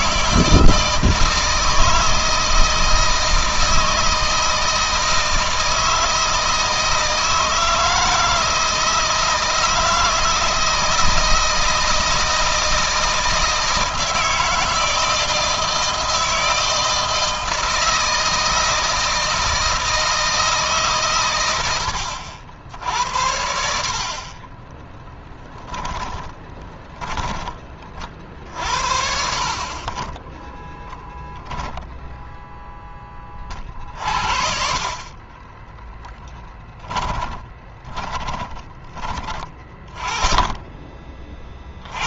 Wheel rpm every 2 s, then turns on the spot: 160, 160, 160, 160, 160, 160, 160, 160, 160, 160, 130, 70, 20, 20, 50, 0, 20, 40, 20, 20, 20.
24-26 34-38